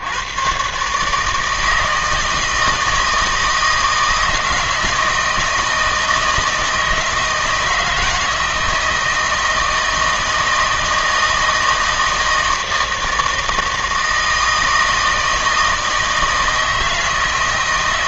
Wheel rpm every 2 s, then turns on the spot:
140, 160, 160, 160, 160, 160, 160, 160, 160.
none